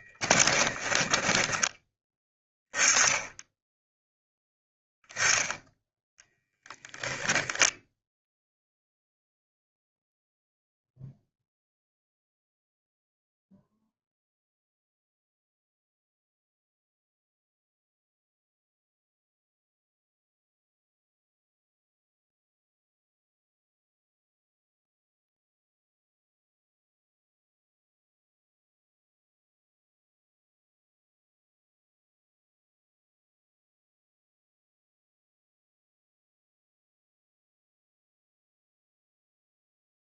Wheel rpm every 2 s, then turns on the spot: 10, 10, 10, 0, 0, 0, 0, 0, 0, 0, 0, 0, 0, 0, 0, 0, 0, 0, 0, 0.
0-2